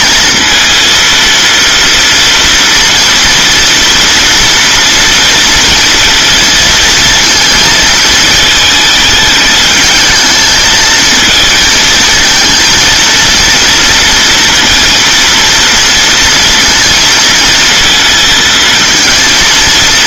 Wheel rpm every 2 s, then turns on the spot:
230, 230, 230, 230, 220, 220, 230, 230, 230, 230.
none